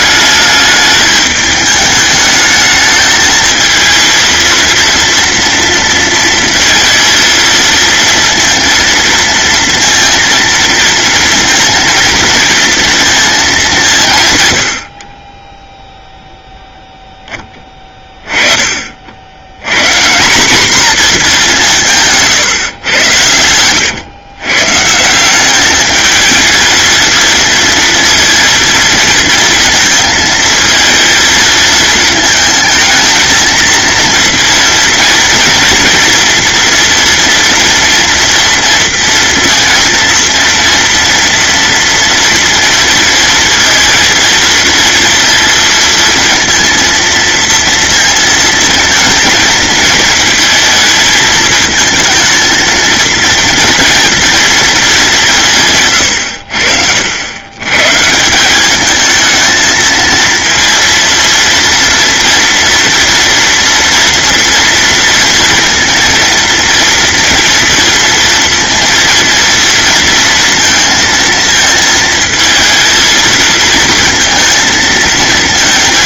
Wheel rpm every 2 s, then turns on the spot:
210, 220, 230, 230, 230, 230, 230, 70, 0, 50, 230, 110, 140, 220, 230, 220, 220, 230, 230, 230, 230, 230, 230, 230, 220, 220, 220, 210, 80, 210, 230, 240, 230, 230, 230, 230, 220, 220.
none